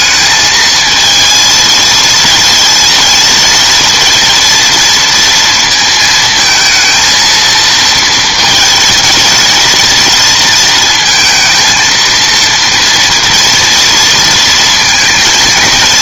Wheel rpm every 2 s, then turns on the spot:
220, 230, 230, 220, 220, 230, 230, 230.
none